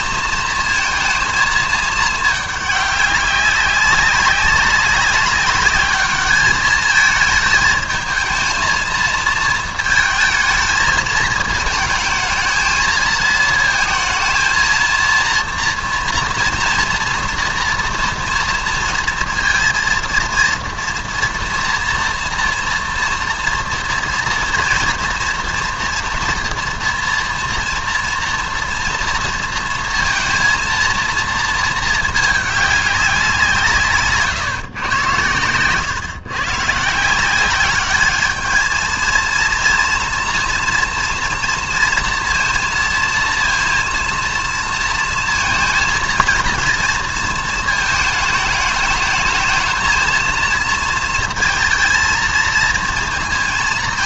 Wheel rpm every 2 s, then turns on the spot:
230, 210, 200, 210, 220, 220, 220, 230, 230, 230, 230, 240, 240, 240, 230, 220, 210, 120, 140, 220, 230, 230, 230, 230, 210, 220, 220.
none